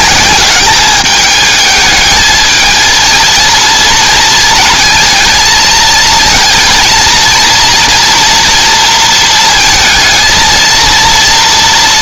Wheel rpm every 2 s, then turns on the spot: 200, 220, 220, 230, 230, 230.
none